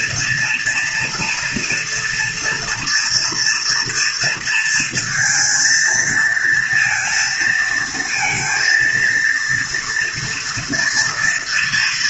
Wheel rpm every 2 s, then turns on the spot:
240, 240, 230, 230, 230, 230.
none